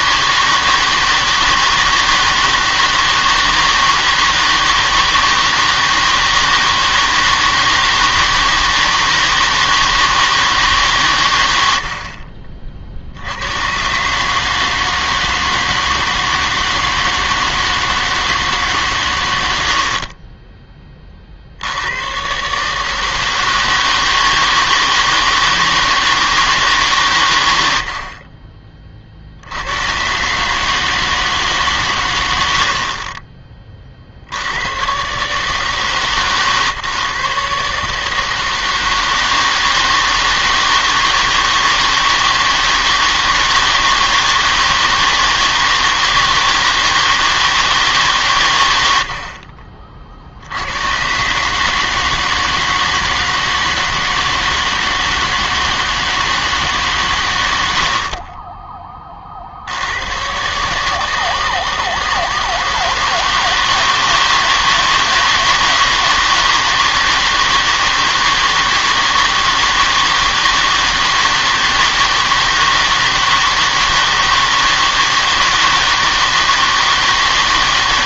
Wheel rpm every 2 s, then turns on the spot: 160, 160, 160, 160, 160, 150, 50, 150, 160, 140, 20, 140, 160, 150, 30, 150, 60, 90, 140, 160, 160, 160, 160, 160, 120, 90, 160, 160, 150, 20, 140, 160, 160, 160, 160, 160, 160, 160, 160.
58-60